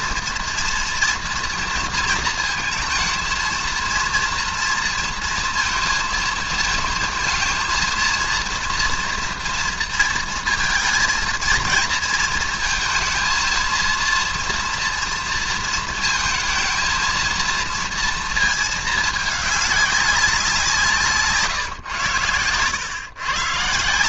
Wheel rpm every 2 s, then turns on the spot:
230, 220, 230, 220, 230, 230, 220, 230, 230, 220, 170, 110.
none